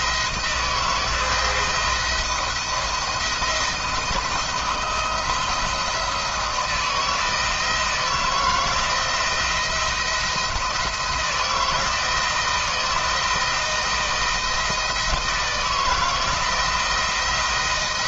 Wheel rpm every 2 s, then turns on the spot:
170, 170, 170, 160, 170, 160, 160, 160, 170.
none